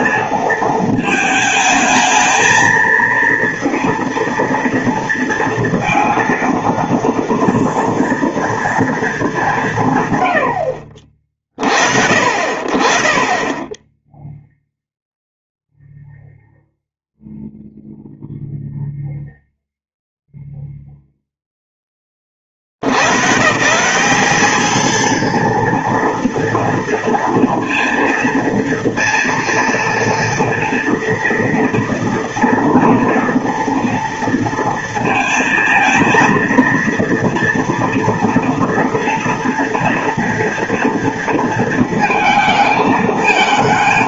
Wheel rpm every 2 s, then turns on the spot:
230, 220, 230, 230, 230, 90, 50, 0, 0, 0, 0, 60, 210, 230, 230, 230, 230, 230, 230, 230, 230, 220.
none